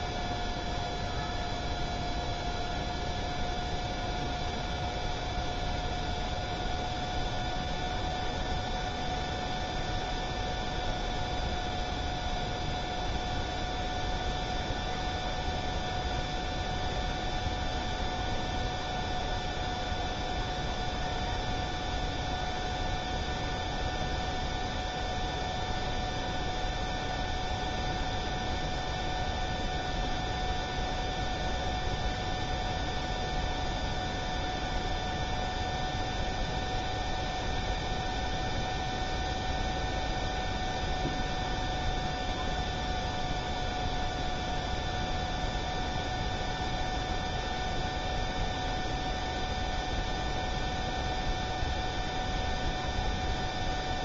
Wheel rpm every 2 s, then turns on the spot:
0, 0, 0, 0, 0, 0, 0, 0, 0, 0, 0, 0, 0, 0, 0, 0, 0, 0, 0, 0, 0, 0, 0, 0, 0, 0, 0.
none